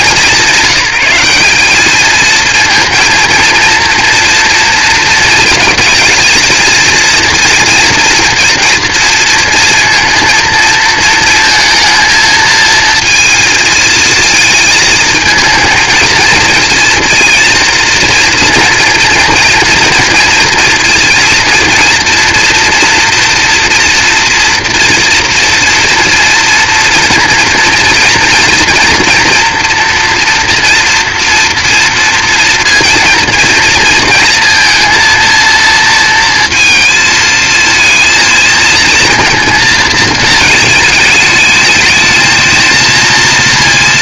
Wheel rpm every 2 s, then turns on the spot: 190, 230, 240, 230, 230, 230, 220, 220, 230, 230, 230, 230, 230, 230, 230, 230, 230, 220, 230, 230, 220, 220.
none